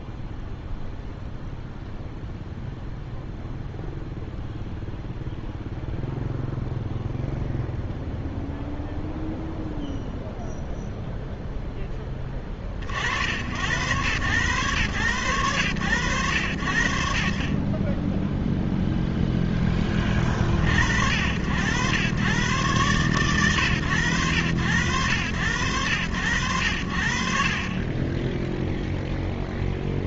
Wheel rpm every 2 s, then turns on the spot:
10, 0, 0, 0, 0, 0, 10, 110, 70, 10, 40, 110, 80, 90, 0.
none